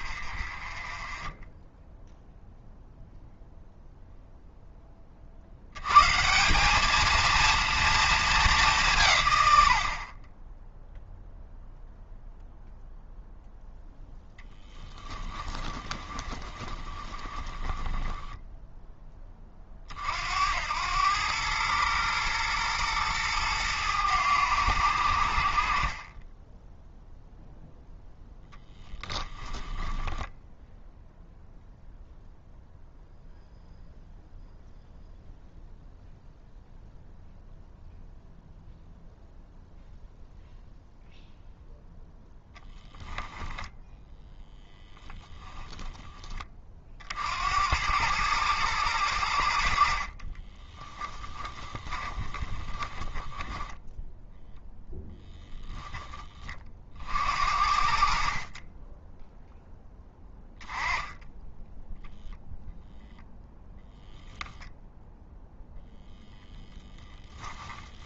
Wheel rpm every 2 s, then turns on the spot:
20, 0, 20, 210, 160, 10, 0, 10, 20, 20, 100, 110, 80, 0, 10, 0, 0, 0, 0, 0, 0, 10, 0, 40, 100, 20, 20, 0, 50, 10, 10, 0, 0, 0.
14-18 28-30 50-54